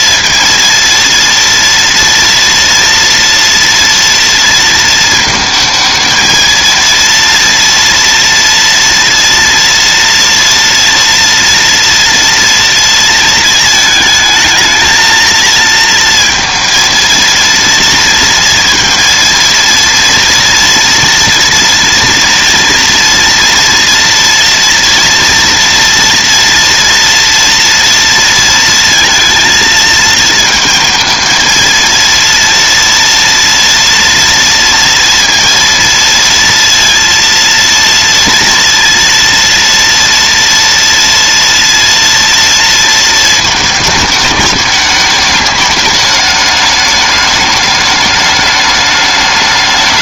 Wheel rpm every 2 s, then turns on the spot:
230, 230, 230, 230, 230, 230, 230, 220, 230, 230, 230, 230, 230, 230, 230, 230, 230, 230, 230, 230, 230, 230, 210, 210, 210.
none